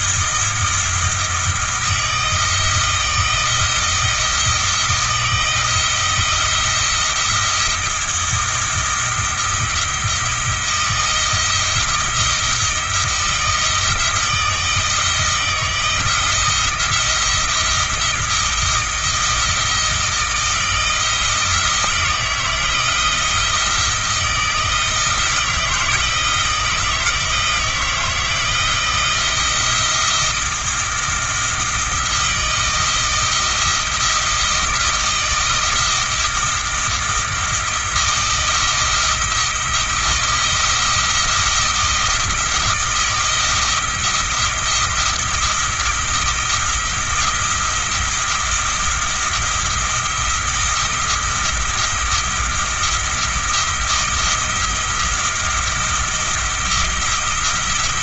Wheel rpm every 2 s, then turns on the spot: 160, 170, 160, 170, 170, 170, 160, 160, 170, 170, 160, 170, 160, 160, 160, 170, 170, 160, 170, 170, 170, 160, 170, 160, 170, 170, 170, 170, 170.
none